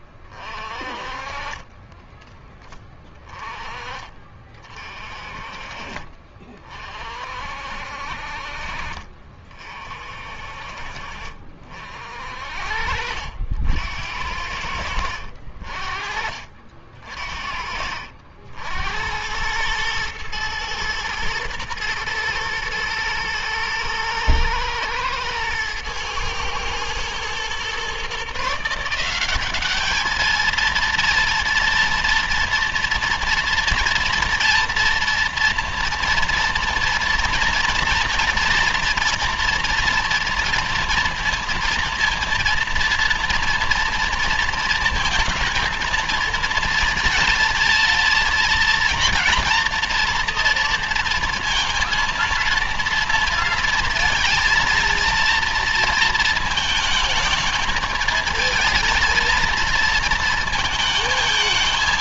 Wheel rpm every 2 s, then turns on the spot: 40, 20, 40, 40, 50, 50, 60, 70, 40, 80, 110, 120, 110, 110, 170, 230, 230, 230, 230, 230, 230, 230, 220, 230, 230, 230, 230, 230, 220, 230, 220.
0-2